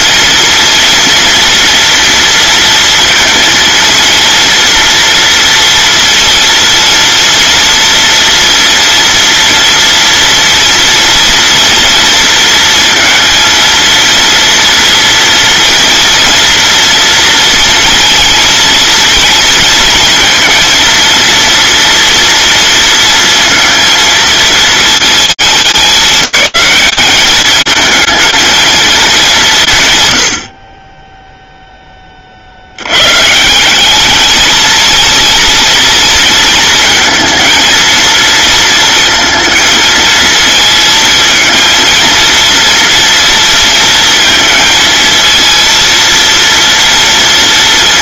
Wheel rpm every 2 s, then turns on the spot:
240, 230, 230, 230, 240, 230, 230, 230, 230, 230, 230, 230, 220, 210, 230, 40, 80, 230, 220, 230, 230, 230, 230, 230.
none